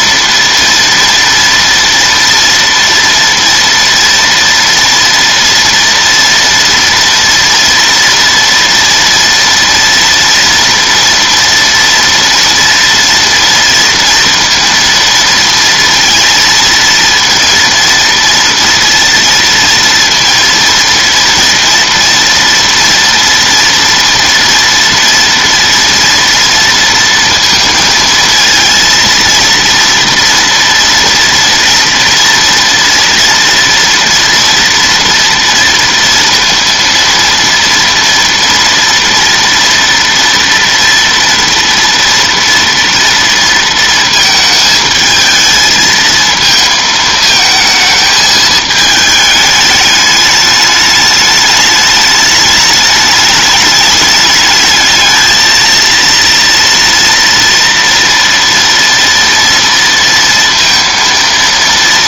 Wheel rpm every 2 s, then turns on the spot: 230, 230, 230, 230, 240, 230, 240, 230, 230, 230, 230, 230, 230, 230, 230, 230, 230, 230, 230, 230, 230, 230, 220, 220, 220, 210, 210, 210, 230, 230, 230.
none